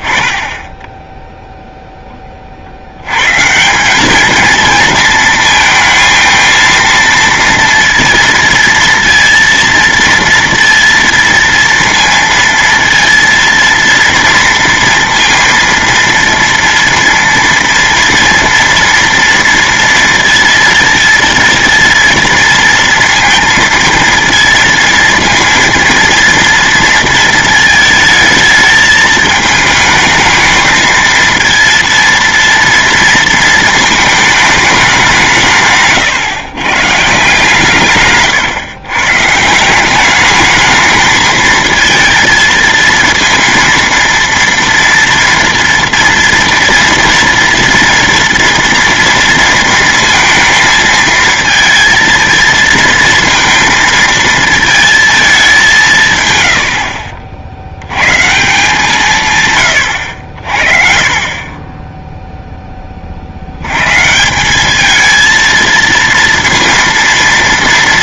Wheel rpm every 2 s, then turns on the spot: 10, 60, 220, 230, 230, 230, 230, 230, 230, 230, 230, 230, 230, 230, 220, 220, 230, 210, 140, 130, 210, 230, 230, 230, 230, 230, 230, 230, 70, 160, 50, 10, 200, 230.
56-58